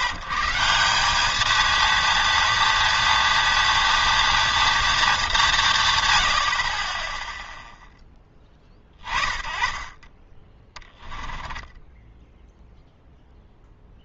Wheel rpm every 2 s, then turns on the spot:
150, 230, 230, 90, 30, 20, 0.
none